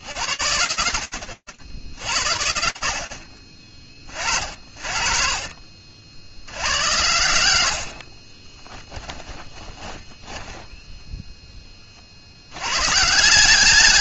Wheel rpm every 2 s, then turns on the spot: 60, 40, 60, 40, 10, 30, 160.
6-10